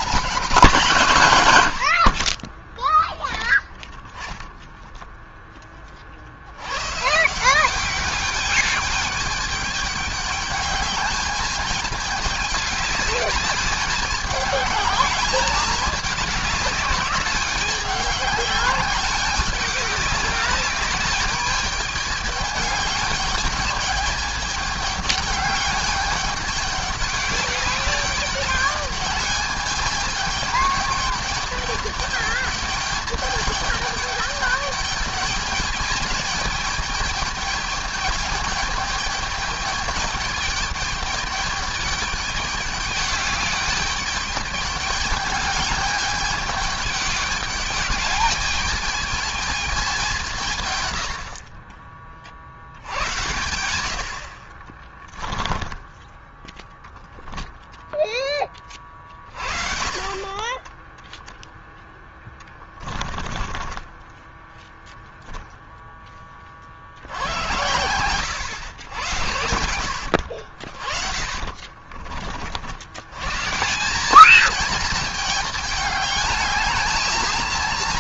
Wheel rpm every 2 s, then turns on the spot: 230, 50, 0, 70, 200, 210, 210, 210, 200, 200, 200, 210, 210, 210, 210, 210, 210, 210, 210, 210, 210, 210, 210, 210, 210, 160, 40, 50, 10, 10, 30, 10, 10, 30, 100, 70, 50, 200, 210.
54-58 60-64 70-72